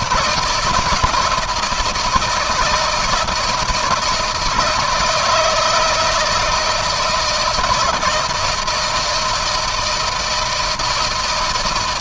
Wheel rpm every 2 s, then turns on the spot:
160, 160, 170, 160, 170, 160.
none